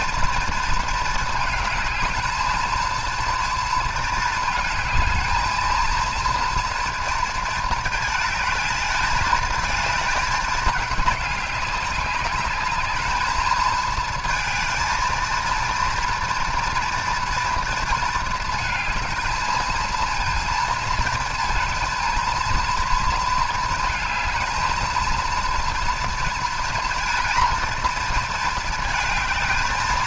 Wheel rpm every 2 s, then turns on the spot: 230, 220, 220, 230, 220, 210, 210, 230, 230, 220, 230, 230, 220, 230, 220.
none